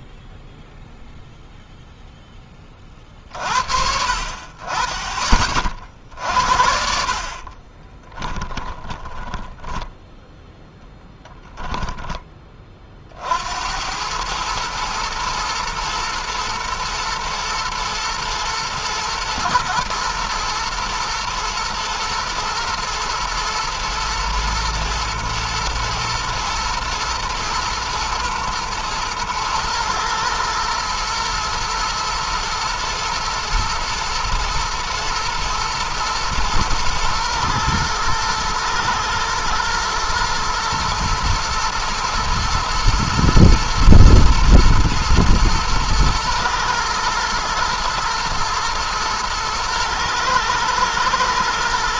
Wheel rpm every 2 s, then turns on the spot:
0, 30, 40, 60, 10, 10, 30, 110, 120, 110, 120, 120, 110, 110, 120, 120, 110, 120, 110, 110, 120, 120, 110, 110, 120, 110.
8-10